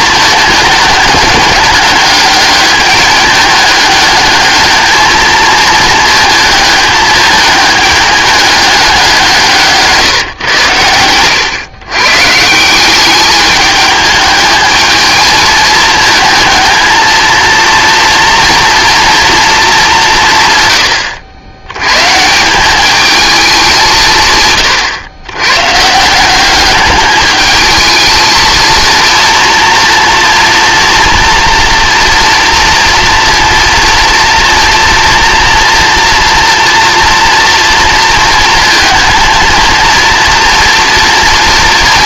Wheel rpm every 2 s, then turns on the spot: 220, 210, 210, 210, 200, 110, 170, 220, 220, 240, 120, 190, 120, 200, 220, 230, 230, 230, 230, 230, 230.
none